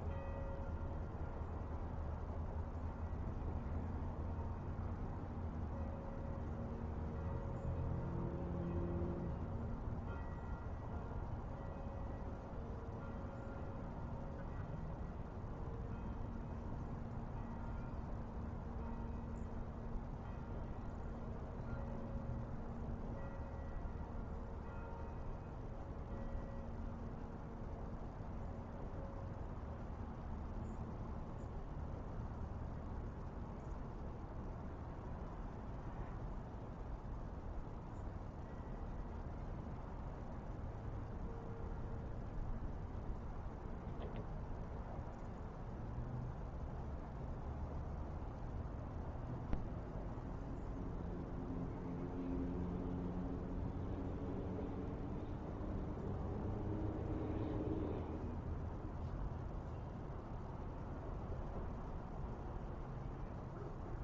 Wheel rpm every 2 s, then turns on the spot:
0, 0, 0, 0, 0, 0, 0, 0, 0, 0, 0, 0, 0, 0, 0, 0, 0, 0, 0, 0, 0, 0, 0, 0, 0, 0, 0, 0, 0, 0, 0, 0.
none